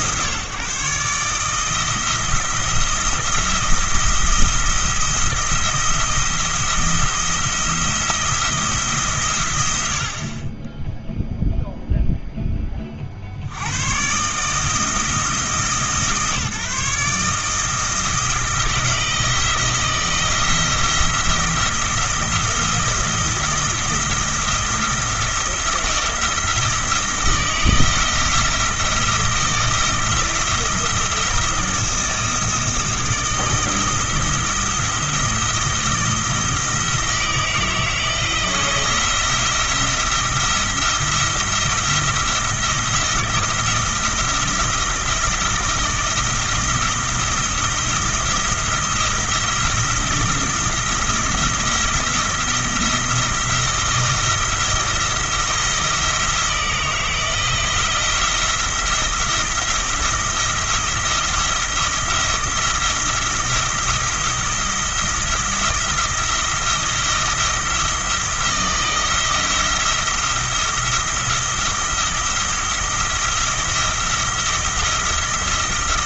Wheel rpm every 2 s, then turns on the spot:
150, 170, 170, 170, 160, 30, 30, 160, 150, 170, 160, 170, 170, 170, 170, 160, 160, 170, 160, 170, 170, 170, 170, 170, 170, 170, 160, 170, 170, 170, 170, 170, 170, 170, 160, 170, 170, 170.
none